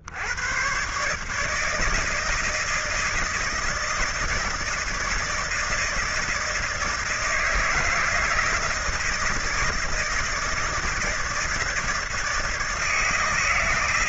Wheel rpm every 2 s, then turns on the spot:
120, 160, 160, 160, 160, 160, 160.
none